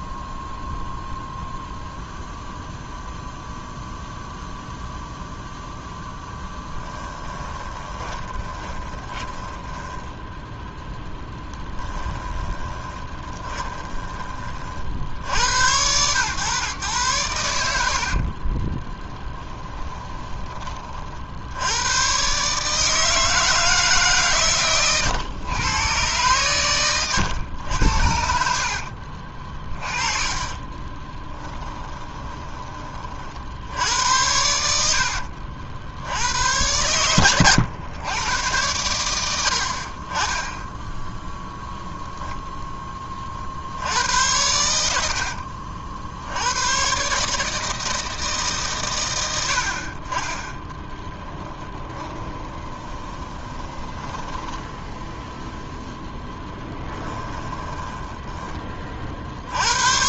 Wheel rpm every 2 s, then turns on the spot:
0, 0, 0, 10, 20, 0, 20, 40, 130, 30, 30, 150, 120, 110, 50, 20, 30, 60, 100, 100, 10, 10, 90, 120, 130, 10, 20, 10, 10, 30.
6-10 12-14 18-20 28-32 50-58